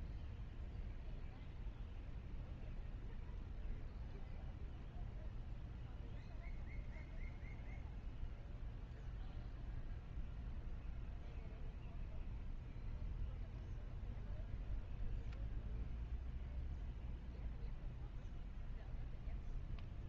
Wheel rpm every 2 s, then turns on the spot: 0, 0, 0, 0, 0, 0, 0, 0, 0, 0.
none